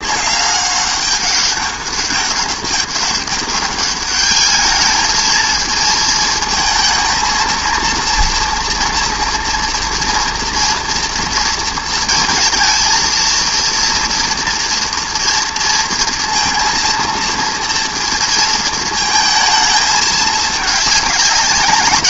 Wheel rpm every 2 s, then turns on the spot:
200, 200, 210, 230, 230, 230, 230, 230, 230, 230, 210.
none